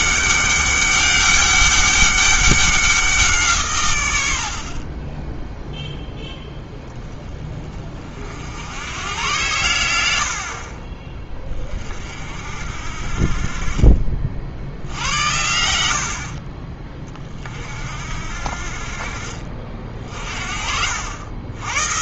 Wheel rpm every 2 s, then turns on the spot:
200, 190, 40, 10, 80, 50, 50, 70, 30, 40, 60.
none